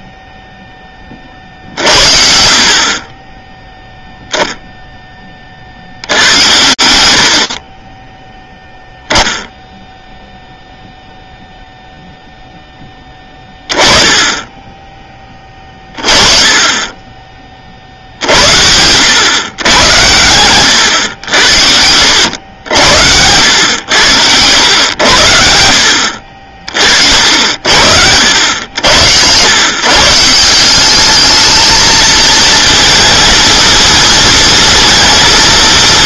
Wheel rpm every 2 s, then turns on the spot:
10, 50, 0, 90, 0, 0, 20, 20, 20, 110, 100, 90, 70, 60, 110, 210, 230, 220.
6-8